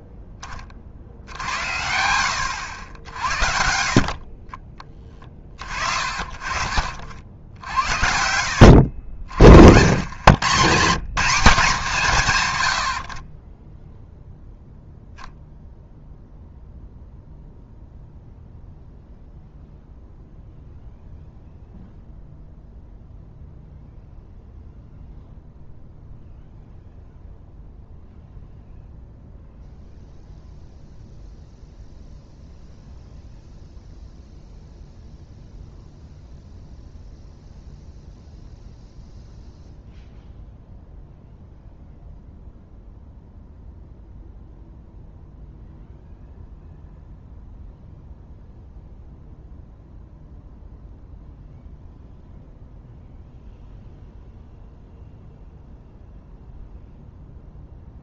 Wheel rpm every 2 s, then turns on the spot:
20, 80, 30, 40, 70, 130, 100, 0, 0, 0, 0, 0, 0, 0, 0, 0, 0, 0, 0, 0, 0, 0, 0, 0, 0, 0, 0, 0, 0.
none